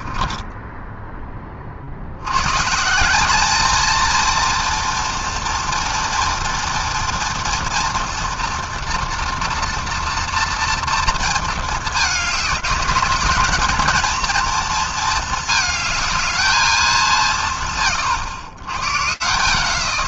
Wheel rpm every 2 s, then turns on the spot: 10, 110, 230, 230, 240, 230, 210, 230, 220, 130.
0-2